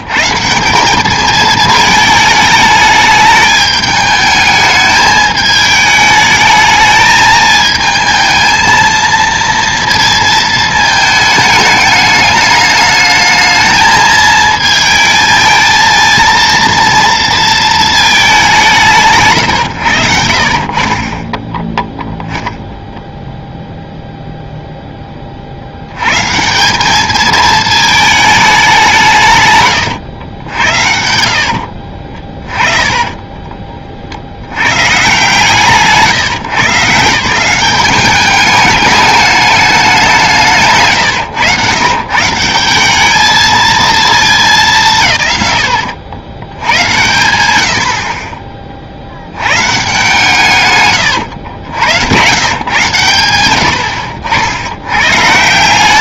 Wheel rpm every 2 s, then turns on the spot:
190, 210, 210, 220, 230, 220, 210, 220, 230, 170, 40, 0, 0, 200, 180, 60, 30, 100, 140, 210, 140, 190, 200, 110, 40, 130, 120, 100.
32-34 50-52